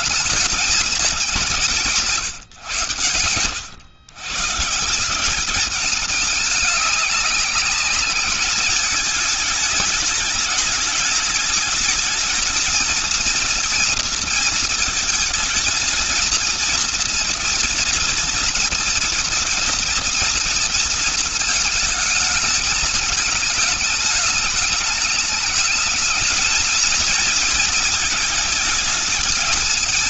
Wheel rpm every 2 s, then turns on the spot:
210, 150, 140, 200, 210, 210, 220, 230, 220, 230, 230, 220, 210, 220, 220.
none